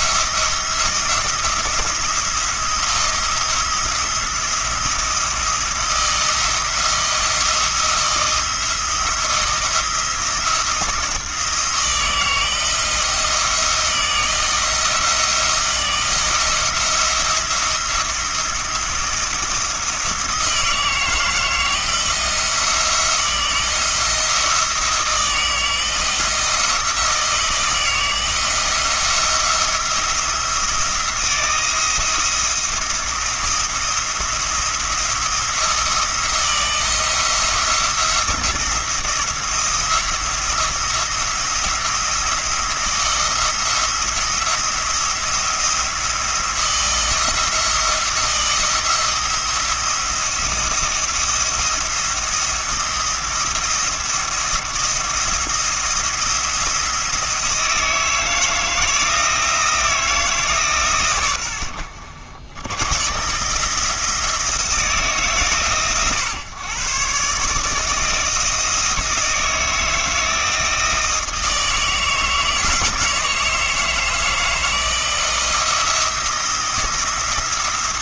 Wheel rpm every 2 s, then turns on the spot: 170, 170, 170, 170, 170, 170, 170, 160, 170, 170, 160, 170, 170, 160, 170, 170, 170, 170, 170, 170, 170, 170, 170, 170, 170, 170, 170, 160, 170, 160, 140, 110, 160, 120, 160, 160, 160, 160, 160.
none